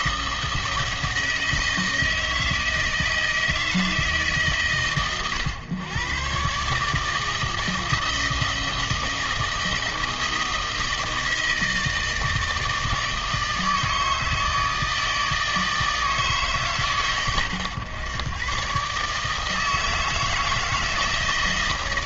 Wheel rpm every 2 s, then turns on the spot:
160, 160, 140, 130, 160, 160, 160, 160, 150, 120, 160.
none